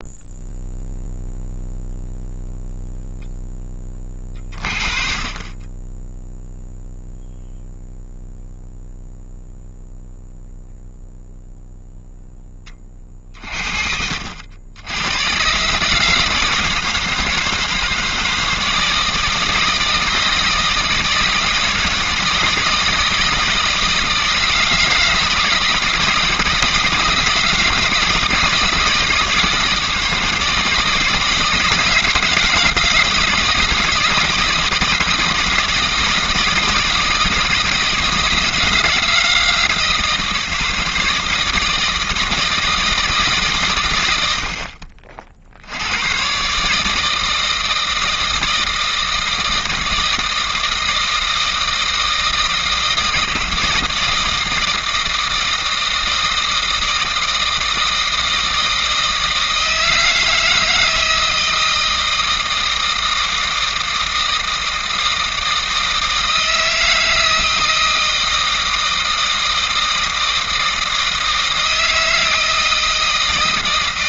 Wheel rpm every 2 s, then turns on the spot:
0, 0, 30, 0, 0, 0, 40, 100, 160, 160, 160, 170, 160, 160, 160, 160, 160, 160, 160, 160, 160, 150, 50, 160, 160, 160, 160, 160, 160, 160, 160, 160, 160, 160, 160, 160, 160.
none